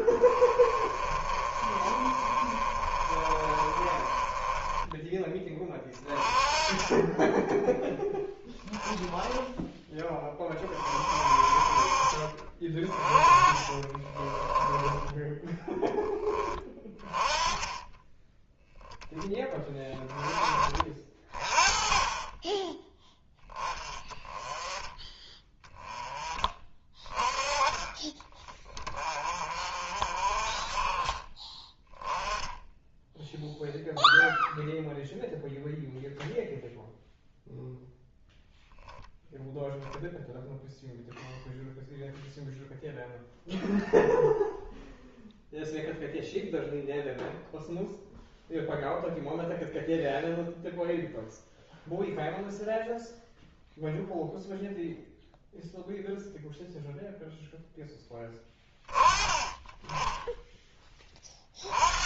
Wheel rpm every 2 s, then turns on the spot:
30, 30, 20, 20, 10, 40, 30, 20, 20, 10, 20, 10, 20, 20, 30, 30, 10, 0, 0, 0, 0, 0, 0, 0, 0, 0, 0, 0, 0, 20, 10.
0-6 14-16